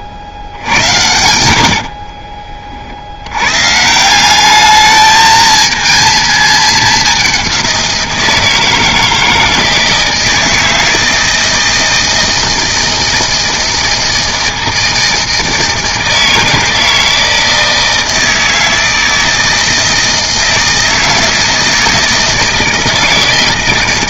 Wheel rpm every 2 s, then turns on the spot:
80, 40, 200, 210, 160, 160, 160, 160, 160, 160, 160, 160.
0-2